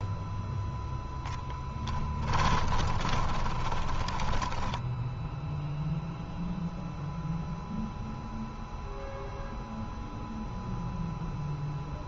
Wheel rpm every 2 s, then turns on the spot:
0, 20, 10, 0, 0, 0.
2-6